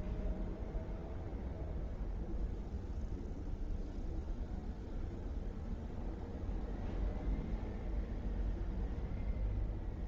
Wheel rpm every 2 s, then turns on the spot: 0, 0, 0, 0, 0.
none